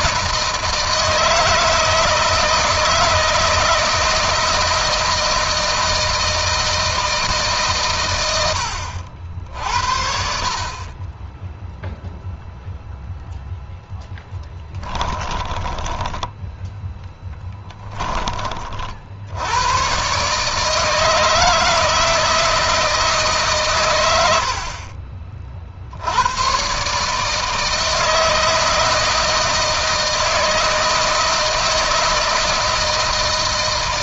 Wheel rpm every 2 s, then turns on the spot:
160, 160, 160, 160, 70, 30, 0, 20, 10, 40, 150, 160, 50, 130, 160, 160, 160.
14-18